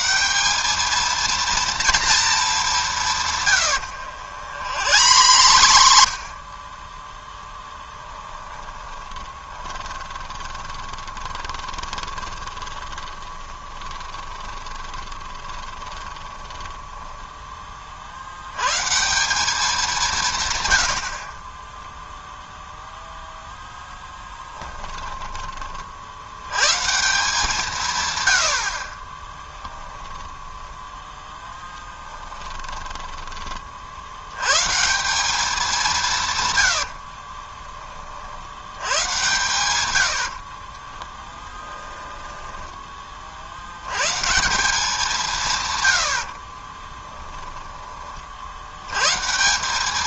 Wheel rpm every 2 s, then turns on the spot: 210, 190, 90, 20, 10, 20, 20, 20, 10, 140, 90, 0, 20, 140, 50, 10, 20, 150, 90, 80, 20, 10, 170, 30, 90.
4-6 8-18 24-26 30-34 36-38 40-42 46-48